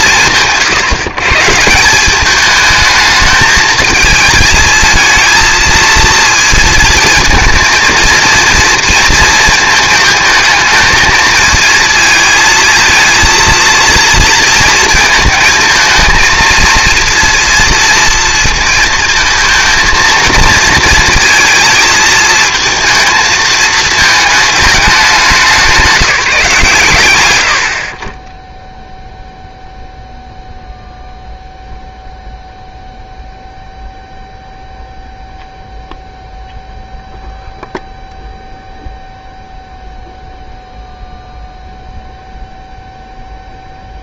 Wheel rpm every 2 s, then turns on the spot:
130, 220, 220, 230, 230, 220, 230, 220, 230, 230, 230, 230, 210, 130, 0, 0, 0, 0, 0, 0, 0, 0.
none